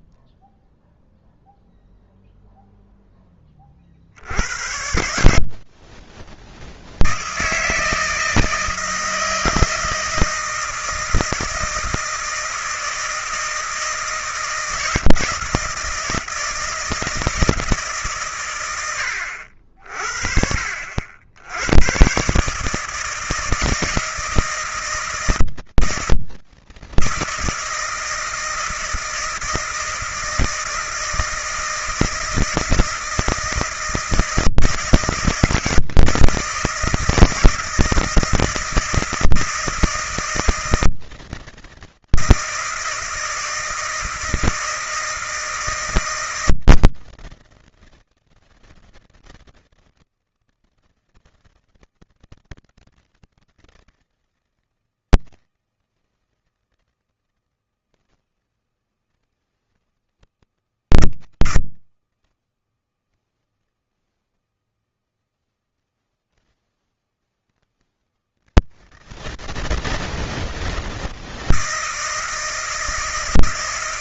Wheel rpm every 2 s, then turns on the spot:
0, 0, 110, 160, 160, 160, 160, 160, 160, 100, 70, 160, 160, 160, 160, 160, 160, 160, 160, 160, 160, 160, 160, 160, 160, 160, 160, 160, 160, 160, 160, 160, 160, 160, 160, 160, 160.
none